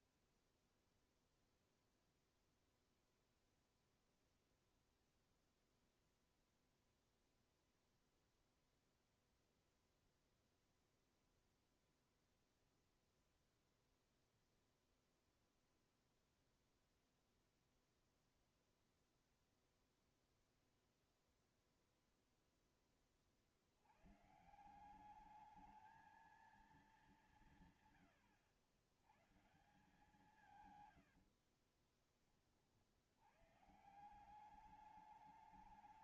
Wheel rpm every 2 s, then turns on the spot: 0, 0, 0, 0, 0, 0, 0, 0, 0, 0, 0, 10, 150, 220, 100, 130, 40, 190.
30-32